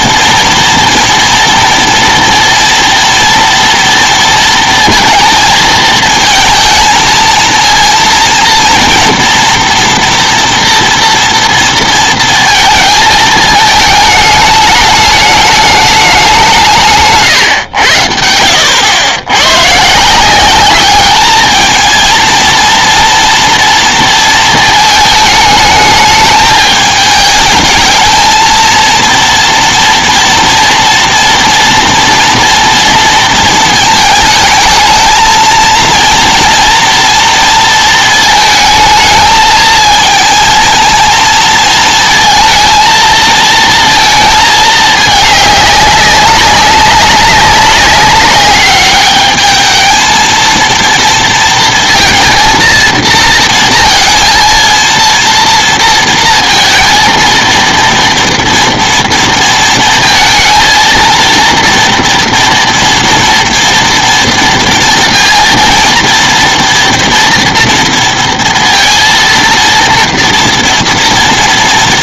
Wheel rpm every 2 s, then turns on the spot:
230, 230, 230, 220, 240, 240, 230, 220, 200, 80, 170, 230, 230, 220, 220, 230, 230, 220, 240, 220, 220, 230, 220, 200, 190, 220, 230, 230, 230, 230, 230, 240, 230, 230, 230, 230.
none